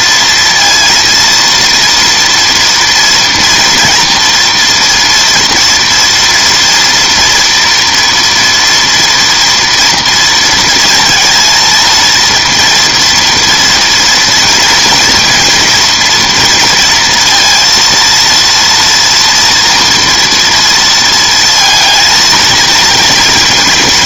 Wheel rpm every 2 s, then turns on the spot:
230, 230, 230, 240, 230, 230, 230, 230, 230, 230, 230, 230.
none